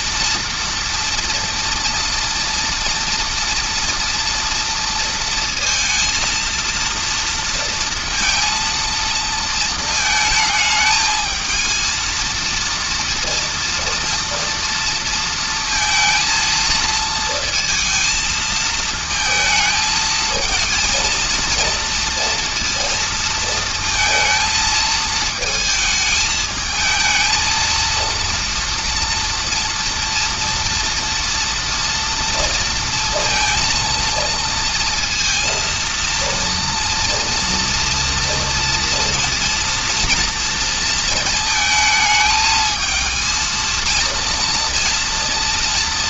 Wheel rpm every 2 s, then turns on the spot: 230, 230, 230, 230, 230, 220, 230, 230, 230, 220, 230, 230, 220, 220, 230, 230, 230, 230, 230, 230, 230, 220, 230.
none